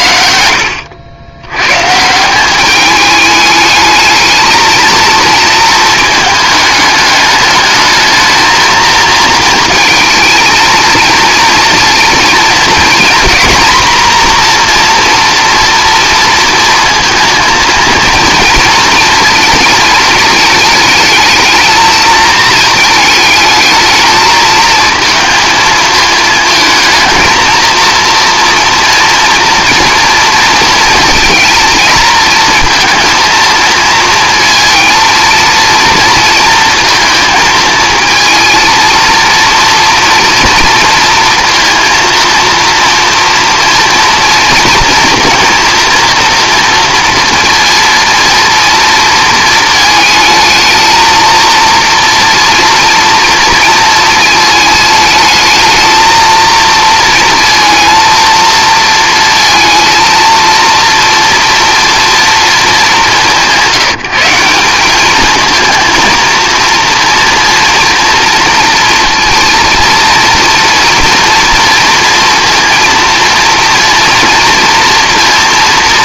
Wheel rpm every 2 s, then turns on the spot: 70, 200, 220, 210, 230, 220, 230, 230, 230, 230, 220, 220, 220, 220, 230, 230, 230, 230, 220, 230, 230, 230, 230, 230, 230, 220, 230, 220, 230, 230, 230, 220, 190, 230, 230, 230, 230, 230.
none